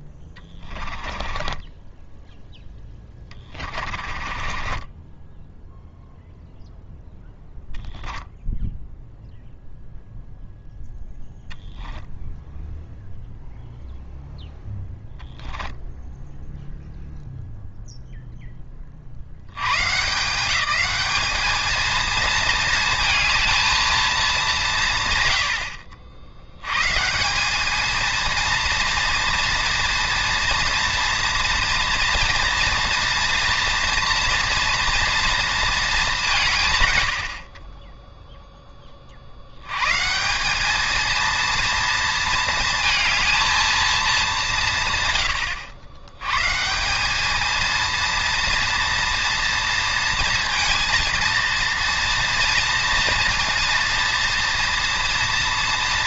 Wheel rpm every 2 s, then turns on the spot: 20, 10, 20, 0, 0, 0, 0, 10, 0, 0, 180, 220, 180, 110, 230, 240, 230, 230, 140, 20, 200, 220, 160, 160, 230, 230, 230, 230.
0-2 4-6